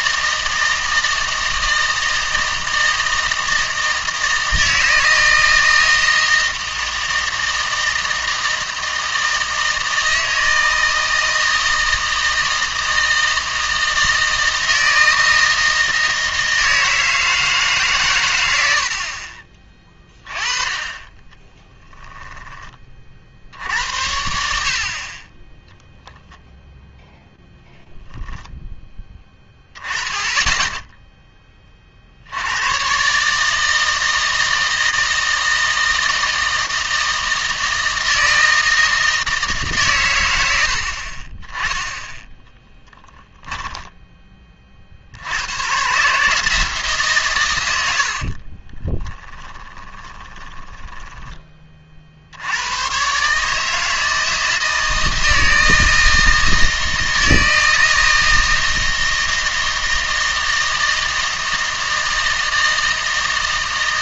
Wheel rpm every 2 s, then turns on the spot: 160, 160, 160, 160, 160, 160, 160, 160, 160, 70, 20, 30, 50, 0, 10, 10, 110, 160, 160, 160, 70, 10, 50, 160, 20, 10, 100, 160, 160, 160, 160, 160.
42-44 48-52